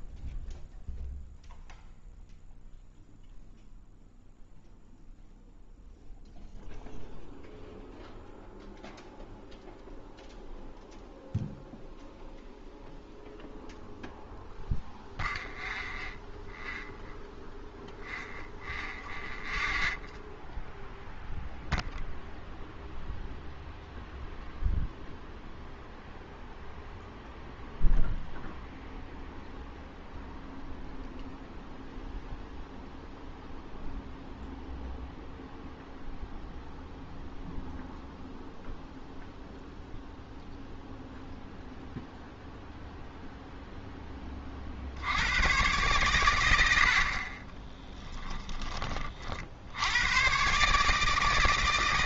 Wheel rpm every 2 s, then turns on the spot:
0, 0, 0, 0, 0, 0, 0, 0, 0, 0, 0, 0, 0, 0, 0, 0, 0, 0, 0, 0, 0, 0, 60, 70, 30, 150.
none